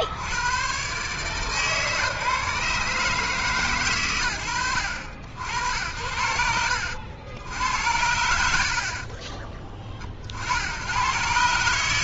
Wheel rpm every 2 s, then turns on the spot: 60, 140, 70, 80, 70, 70.
none